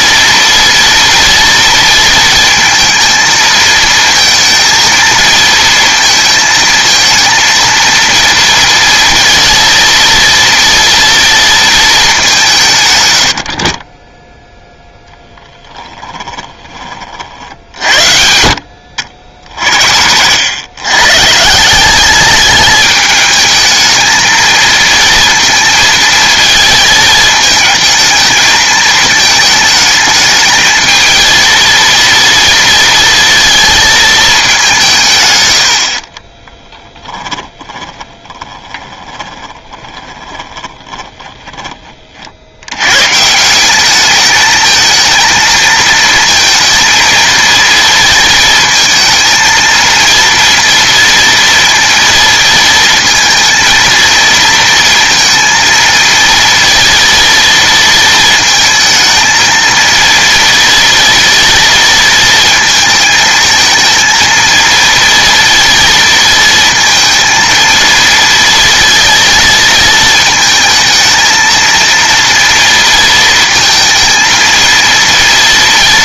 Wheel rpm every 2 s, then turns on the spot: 230, 230, 230, 230, 230, 230, 140, 0, 20, 60, 70, 200, 230, 220, 220, 220, 230, 190, 30, 20, 20, 100, 220, 230, 230, 230, 230, 230, 230, 220, 230, 220, 230, 230, 230, 220, 230, 230.
36-42